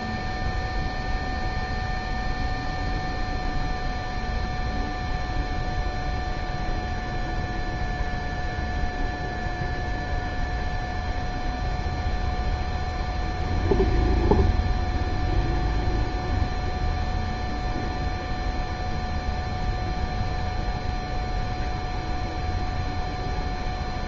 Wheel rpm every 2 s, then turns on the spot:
0, 0, 0, 0, 0, 0, 0, 0, 0, 0, 0, 0.
none